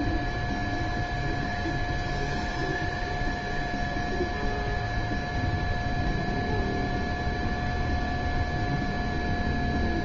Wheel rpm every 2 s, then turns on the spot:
0, 0, 0, 0, 0.
none